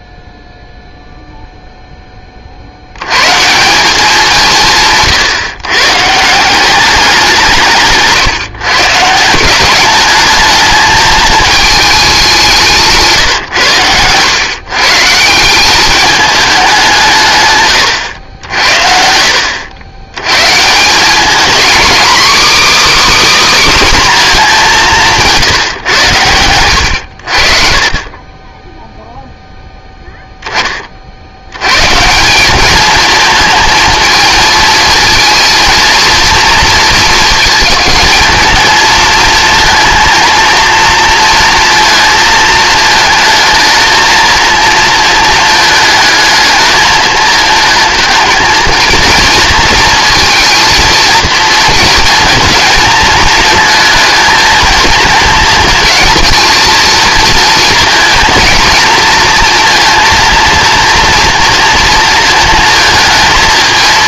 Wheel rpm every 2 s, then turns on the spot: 0, 80, 160, 190, 130, 220, 160, 140, 180, 70, 160, 300, 190, 90, 10, 20, 210, 220, 230, 220, 230, 220, 220, 220, 230, 230, 230, 230, 230, 230, 230, 220.
none